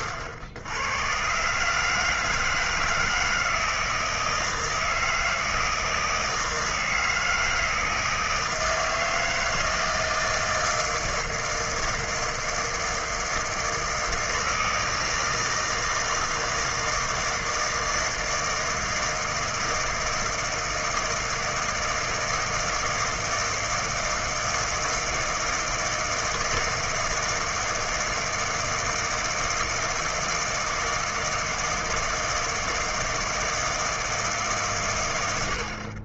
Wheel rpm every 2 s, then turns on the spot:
90, 160, 160, 160, 160, 160, 160, 160, 160, 160, 160, 160, 160, 160, 160, 160, 160, 150.
none